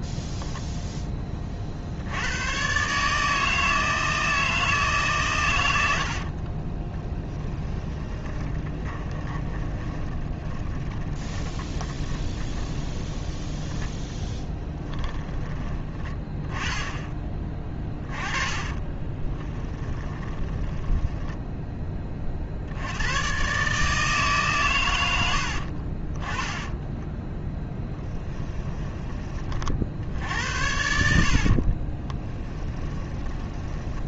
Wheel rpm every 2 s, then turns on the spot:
0, 120, 160, 30, 20, 20, 20, 20, 10, 20, 20, 70, 120, 10, 10, 70, 20.
6-16 18-22 30-34